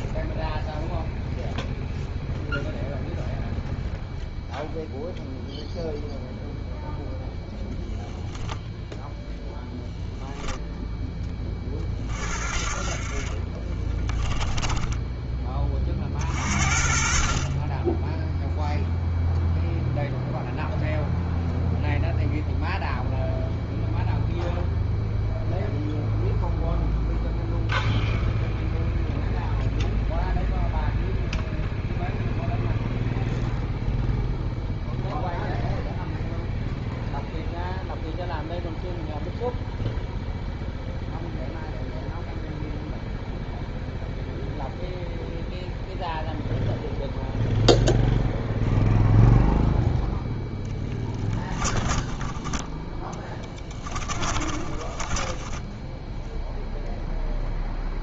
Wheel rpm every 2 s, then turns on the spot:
0, 0, 0, 0, 0, 0, 40, 10, 50, 0, 0, 0, 0, 0, 0, 0, 0, 0, 0, 0, 0, 0, 0, 0, 0, 10, 10, 20, 0.
14-16 50-56